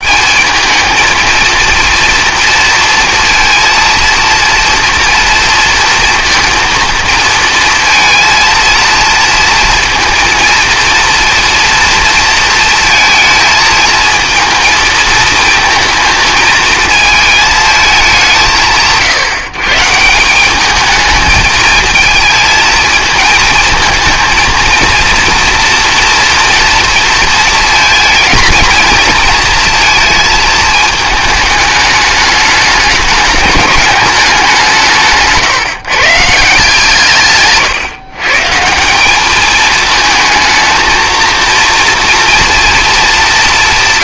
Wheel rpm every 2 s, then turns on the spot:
220, 230, 230, 230, 230, 230, 220, 220, 220, 160, 210, 220, 230, 230, 230, 220, 200, 160, 160, 180, 230, 200.
none